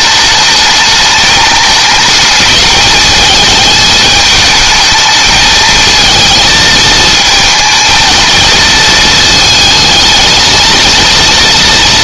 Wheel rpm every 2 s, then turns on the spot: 220, 210, 220, 220, 220, 230.
none